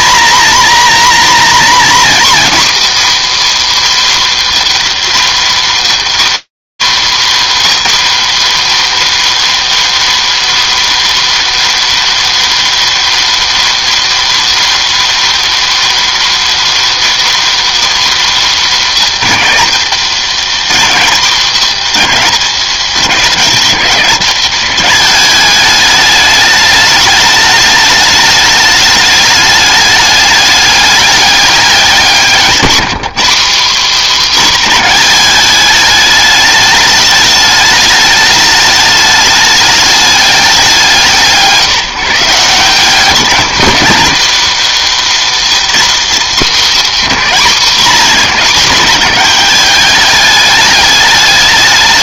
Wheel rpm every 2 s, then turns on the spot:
240, 260, 280, 270, 280, 300, 300, 300, 300, 270, 220, 200, 200, 210, 210, 210, 190, 250, 210, 210, 180, 170, 250, 230, 210, 210.
none